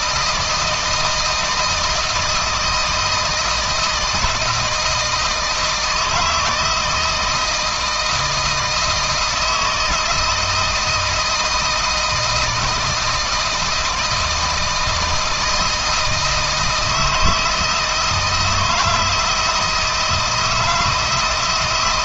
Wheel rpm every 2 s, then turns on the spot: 160, 160, 160, 170, 160, 160, 160, 160, 160, 170, 160.
none